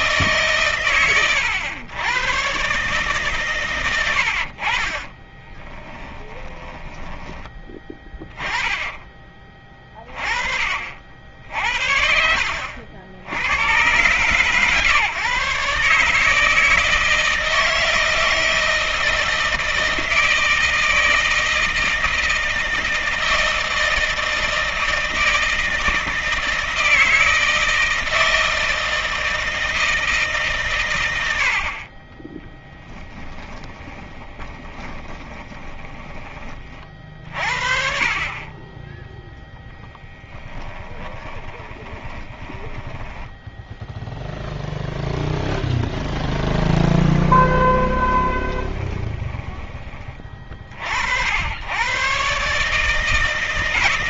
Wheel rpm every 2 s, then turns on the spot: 120, 130, 20, 10, 10, 50, 80, 140, 160, 160, 160, 160, 160, 160, 160, 90, 10, 20, 40, 20, 20, 10, 0, 10, 20, 60, 150.
4-8 32-36 40-44 46-50